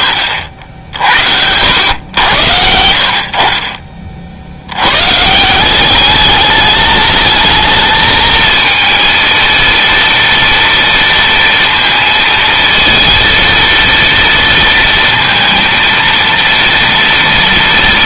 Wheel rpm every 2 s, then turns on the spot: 60, 70, 120, 210, 230, 230, 230, 230, 230.
none